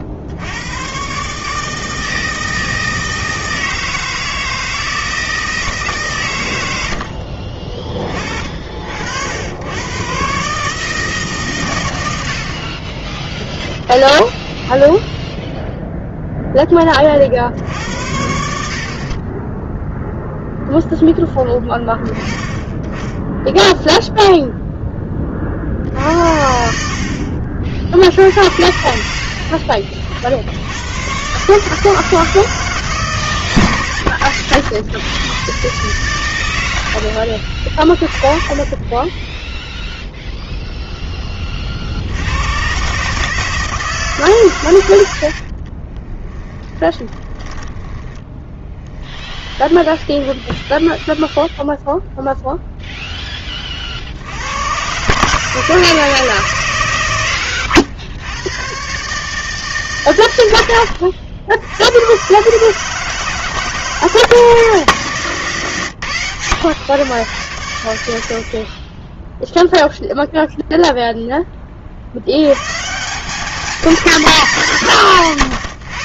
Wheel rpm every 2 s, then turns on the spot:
130, 160, 160, 70, 60, 150, 20, 0, 30, 40, 0, 10, 20, 50, 70, 110, 150, 110, 80, 20, 10, 140, 90, 10, 10, 0, 0, 130, 130, 140, 100, 160, 150, 110, 20, 0, 170, 170.
26-28 38-40 46-50